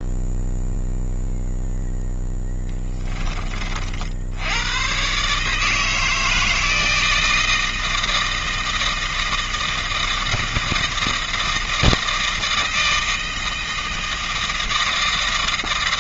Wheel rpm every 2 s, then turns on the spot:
0, 10, 120, 160, 160, 160, 160, 160.
none